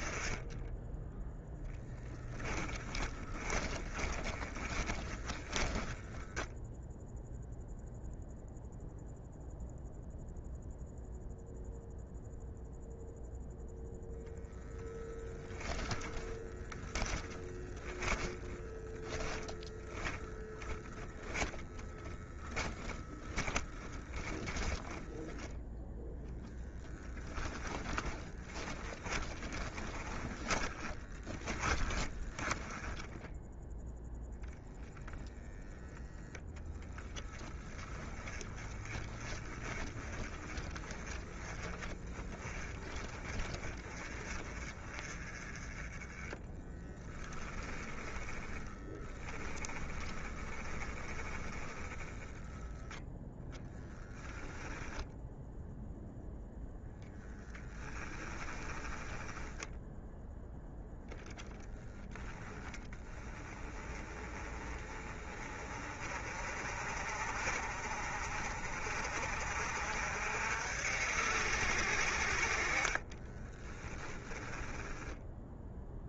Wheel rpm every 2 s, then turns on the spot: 10, 30, 20, 0, 0, 0, 0, 0, 10, 10, 10, 10, 10, 10, 20, 20, 10, 0, 20, 20, 20, 20, 30, 10, 10, 20, 0, 0, 10, 10, 10, 10, 20, 40, 40, 70, 30, 10.
2-6 16-32 46-52 58-60 72-76